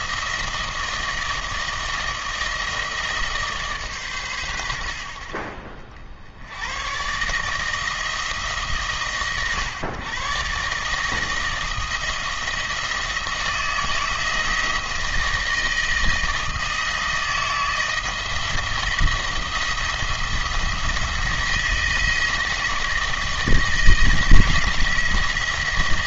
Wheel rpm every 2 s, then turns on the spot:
160, 160, 90, 110, 140, 150, 160, 160, 160, 170, 170, 170, 170.
none